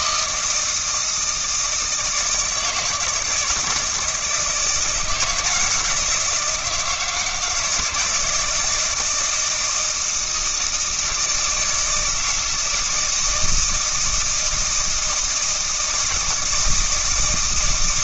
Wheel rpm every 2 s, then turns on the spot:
160, 160, 160, 170, 160, 160, 160, 160, 160.
none